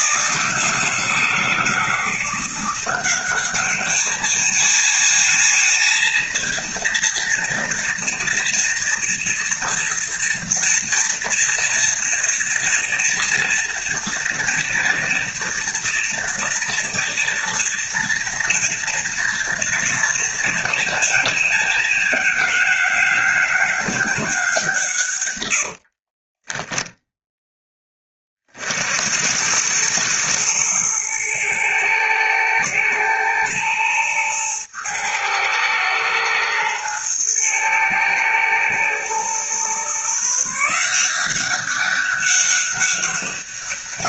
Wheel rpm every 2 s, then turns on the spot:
160, 180, 220, 240, 230, 240, 230, 230, 230, 230, 230, 200, 160, 10, 50, 110, 110, 110, 110, 110, 160, 200.
none